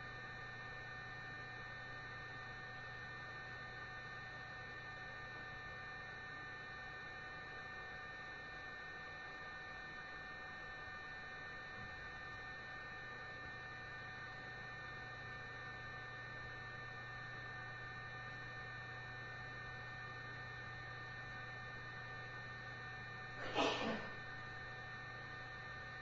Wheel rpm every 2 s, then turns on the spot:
0, 0, 0, 0, 0, 0, 0, 0, 0, 0, 0, 0, 0.
none